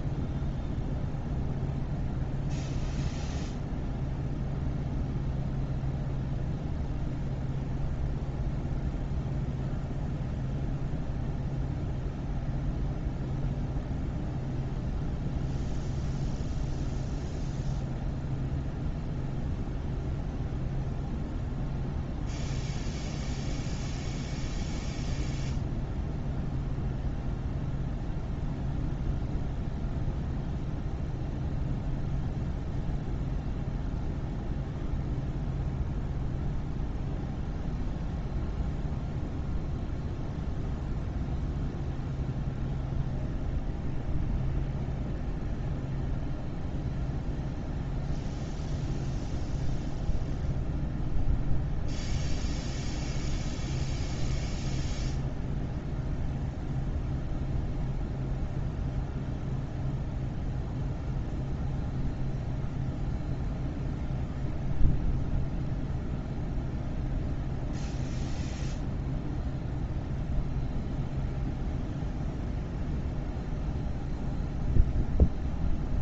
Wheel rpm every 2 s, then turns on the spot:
0, 0, 0, 0, 0, 0, 0, 0, 0, 0, 0, 0, 0, 0, 0, 0, 0, 0, 0, 0, 0, 0, 0, 0, 0, 0, 0, 0, 0, 0, 0, 0, 0, 0, 0, 0, 0, 0.
none